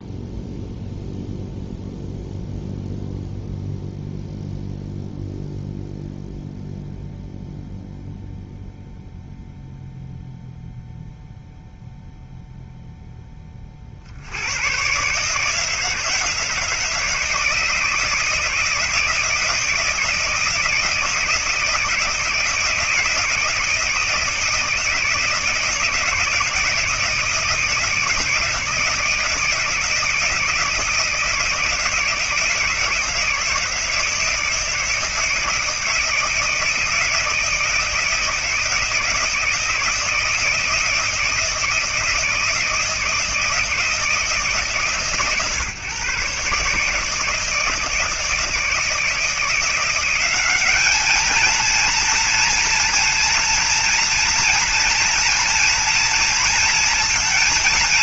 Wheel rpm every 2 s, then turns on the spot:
0, 0, 0, 0, 0, 0, 0, 70, 160, 160, 160, 170, 160, 160, 160, 160, 160, 160, 160, 160, 160, 160, 160, 140, 160, 180, 230, 230, 230.
none